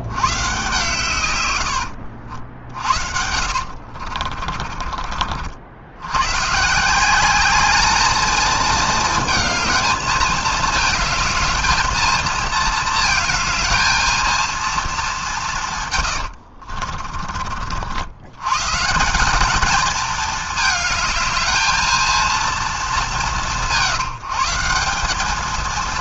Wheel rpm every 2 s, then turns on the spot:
140, 60, 30, 140, 220, 220, 220, 220, 60, 140, 220, 210, 180.
2-6 16-18